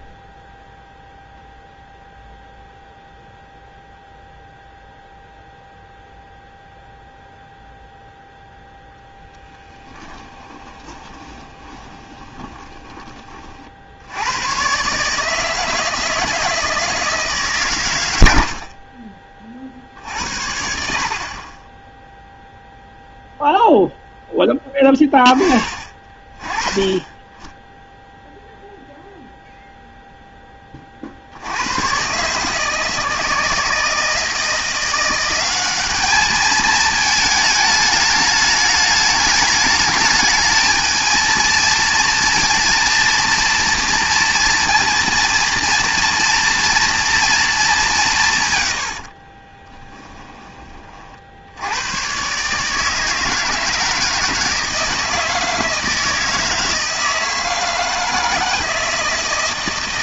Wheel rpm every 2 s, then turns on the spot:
0, 0, 0, 0, 0, 20, 20, 120, 160, 80, 70, 0, 10, 30, 0, 20, 150, 170, 220, 210, 220, 230, 230, 230, 120, 20, 140, 160, 160, 160.
10-14 48-50